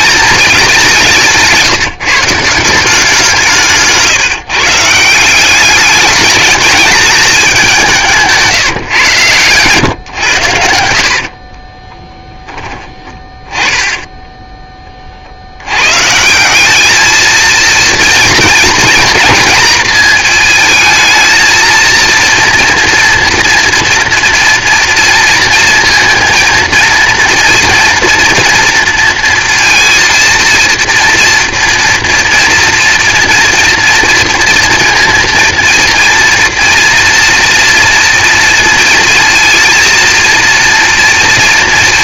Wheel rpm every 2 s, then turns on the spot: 200, 160, 150, 210, 160, 100, 30, 20, 190, 230, 230, 230, 230, 230, 230, 230, 230, 230, 230, 230, 230.
8-14